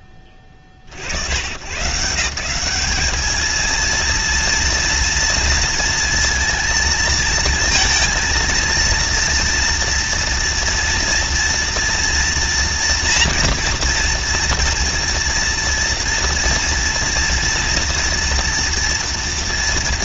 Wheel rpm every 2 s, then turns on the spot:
50, 190, 230, 220, 230, 230, 230, 230, 230, 230.
none